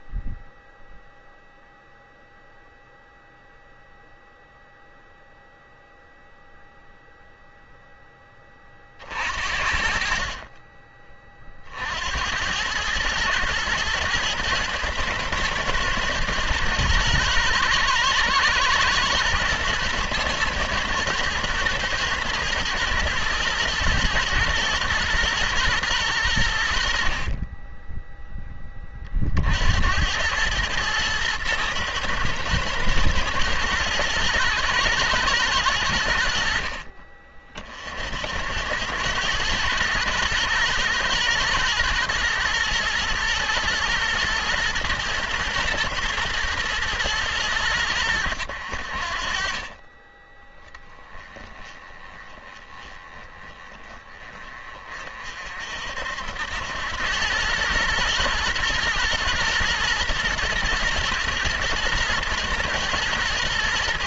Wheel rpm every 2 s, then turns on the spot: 0, 0, 0, 0, 30, 30, 100, 110, 110, 120, 110, 110, 120, 80, 20, 110, 110, 110, 60, 90, 120, 120, 110, 120, 80, 10, 20, 30, 90, 120, 120, 110.
none